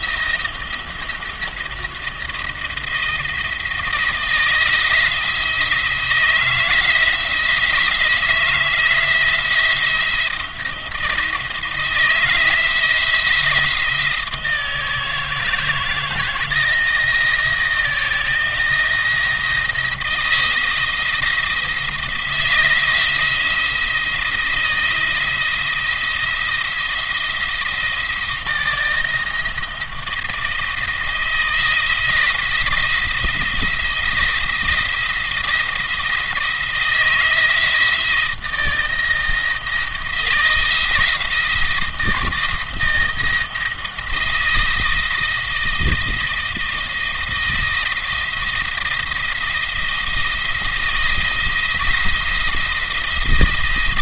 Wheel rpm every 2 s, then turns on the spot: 170, 170, 170, 160, 160, 160, 170, 160, 160, 160, 170, 170, 170, 170, 160, 160, 160, 170, 160, 160, 170, 170, 170, 160, 170, 170, 170.
none